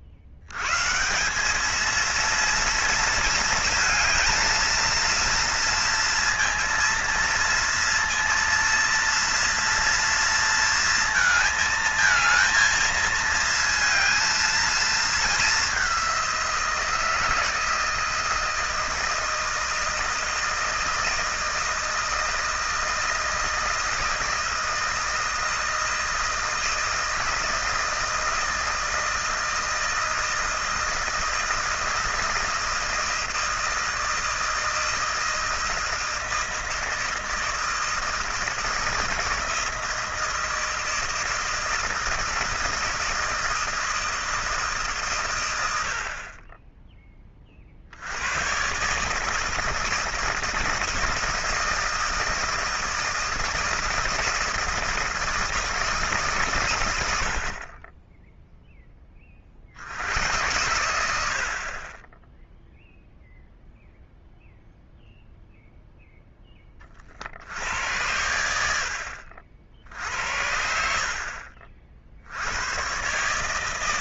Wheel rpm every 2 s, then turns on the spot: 140, 230, 230, 230, 230, 230, 220, 220, 170, 160, 160, 160, 160, 160, 160, 160, 160, 160, 160, 160, 160, 160, 150, 20, 130, 160, 160, 160, 110, 0, 100, 0, 0, 20, 70, 60, 100.
none